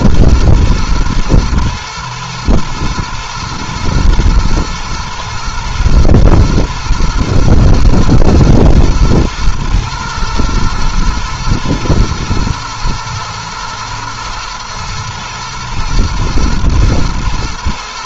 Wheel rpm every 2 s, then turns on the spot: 110, 110, 110, 120, 110, 120, 110, 110, 120.
none